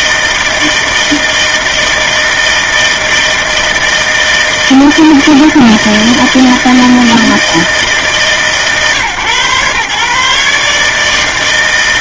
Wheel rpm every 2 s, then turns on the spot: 160, 160, 160, 160, 130, 150.
none